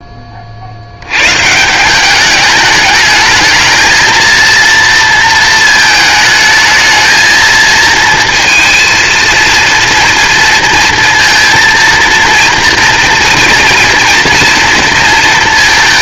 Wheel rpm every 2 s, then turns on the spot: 40, 210, 230, 220, 230, 230, 240, 230.
none